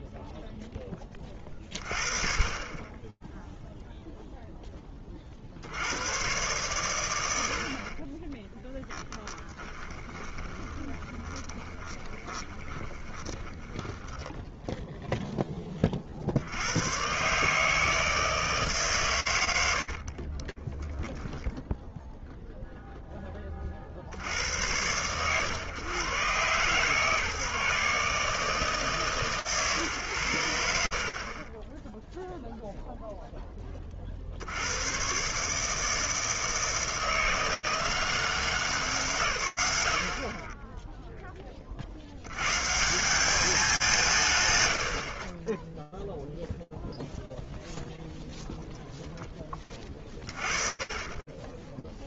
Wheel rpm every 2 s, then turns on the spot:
0, 30, 0, 90, 50, 20, 20, 10, 100, 150, 10, 0, 100, 150, 150, 50, 0, 120, 160, 160, 0, 190, 40, 0, 10, 20.
10-16 20-22